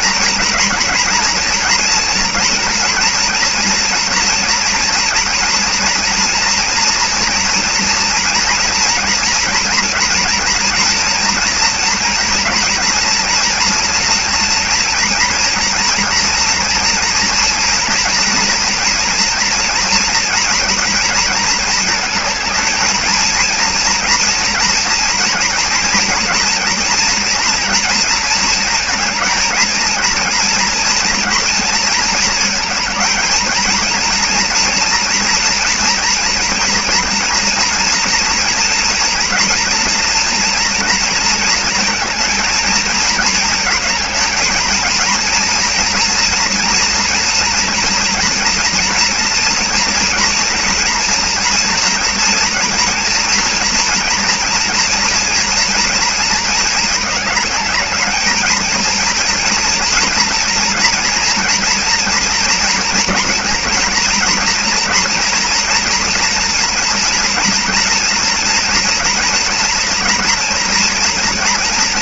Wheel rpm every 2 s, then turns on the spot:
230, 240, 230, 230, 230, 230, 240, 230, 230, 230, 230, 220, 230, 230, 220, 230, 220, 230, 230, 230, 230, 230, 220, 240, 230, 230, 230, 230, 220, 220, 230, 230, 240, 230, 230, 230.
none